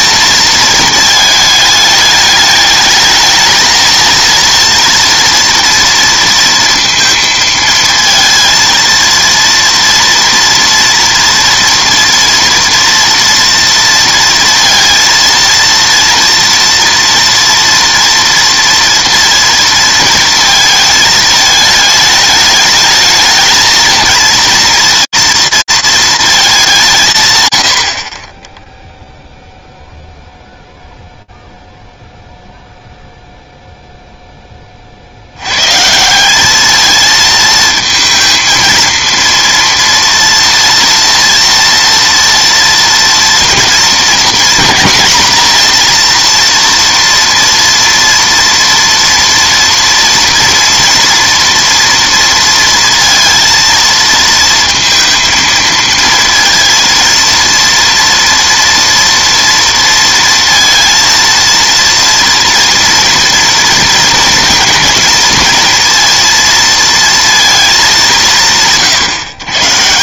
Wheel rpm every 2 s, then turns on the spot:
220, 220, 230, 230, 230, 240, 240, 230, 230, 230, 220, 210, 230, 180, 0, 0, 0, 60, 220, 230, 230, 230, 240, 230, 230, 230, 230, 230, 230, 230, 230, 230, 230, 230, 140.
none